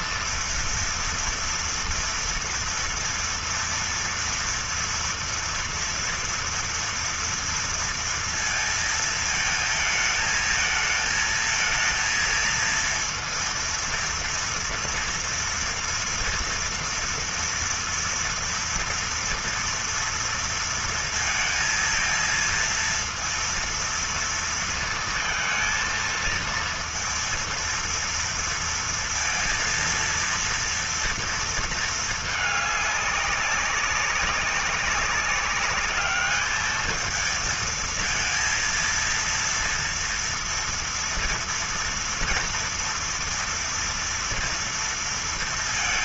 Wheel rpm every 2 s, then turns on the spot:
240, 230, 230, 230, 230, 220, 230, 230, 230, 230, 230, 230, 230, 230, 230, 230, 210, 200, 220, 230, 230, 230, 230.
none